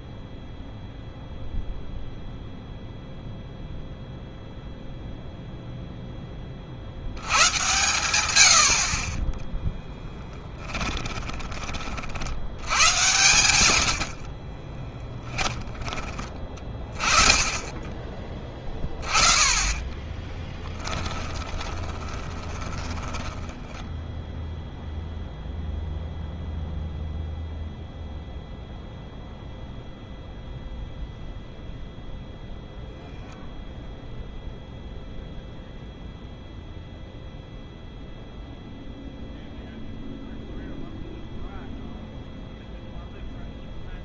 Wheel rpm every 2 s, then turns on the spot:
0, 0, 0, 50, 60, 20, 100, 30, 30, 20, 10, 10, 0, 0, 0, 0, 0, 0, 0, 0, 0, 0.
10-12 14-16 20-24